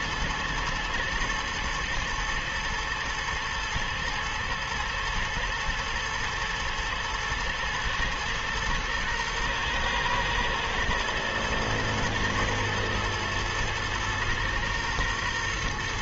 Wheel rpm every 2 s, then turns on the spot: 120, 120, 120, 110, 120, 110, 120, 120.
none